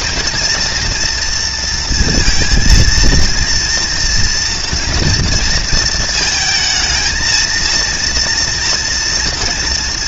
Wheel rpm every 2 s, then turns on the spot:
230, 230, 230, 220, 230.
none